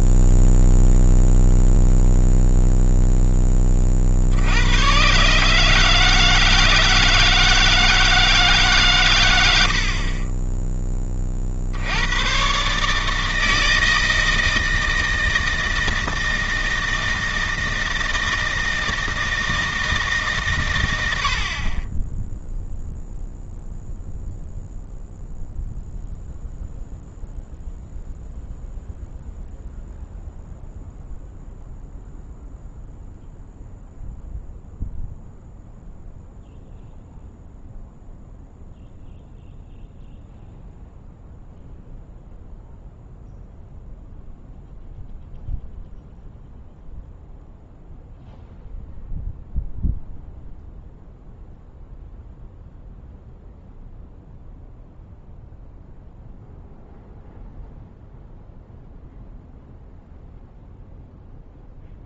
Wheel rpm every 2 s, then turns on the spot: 0, 0, 100, 160, 150, 10, 130, 160, 160, 160, 120, 0, 0, 0, 0, 0, 0, 0, 0, 0, 0, 0, 0, 0, 0, 0, 0, 0, 0, 0, 0.
none